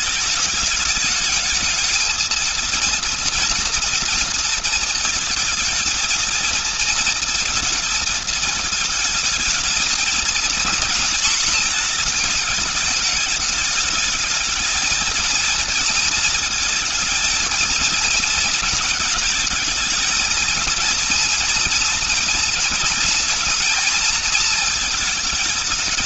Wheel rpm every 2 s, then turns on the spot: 220, 230, 230, 230, 220, 230, 220, 220, 230, 220, 230, 230, 220.
none